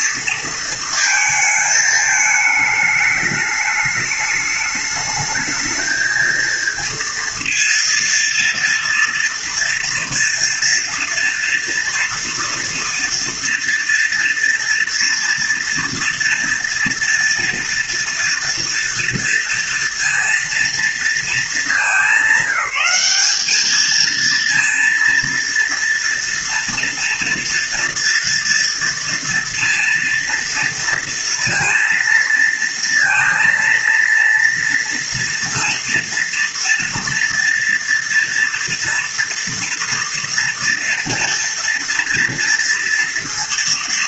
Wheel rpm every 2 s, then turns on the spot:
230, 210, 210, 230, 230, 230, 230, 240, 230, 230, 230, 190, 230, 230, 230, 230, 230, 230, 230, 230, 230, 230.
none